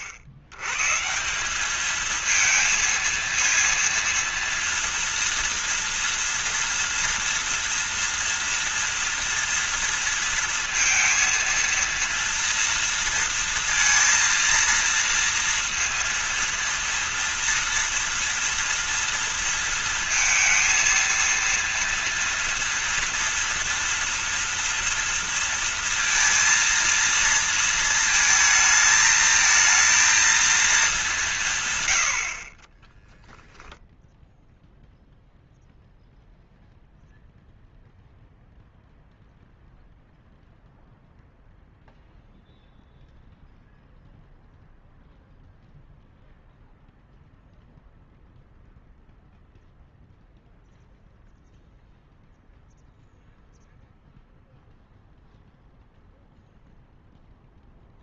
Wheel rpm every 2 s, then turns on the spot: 90, 220, 230, 230, 240, 230, 230, 230, 230, 230, 230, 240, 230, 230, 220, 220, 30, 0, 0, 0, 0, 0, 0, 0, 0, 0, 0, 0, 0.
none